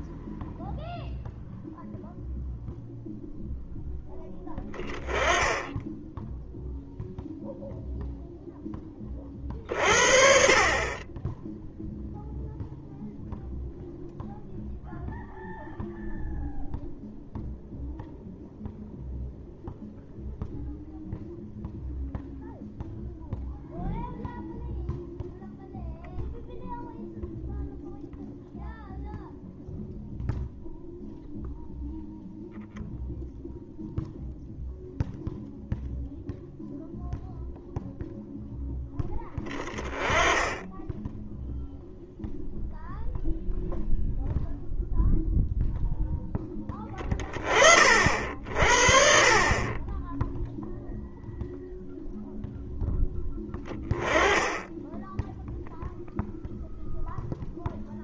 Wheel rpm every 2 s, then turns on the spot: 0, 0, 10, 0, 20, 20, 0, 0, 0, 0, 0, 0, 0, 0, 0, 0, 0, 0, 0, 10, 10, 0, 0, 20, 40, 0, 10, 10, 0.
none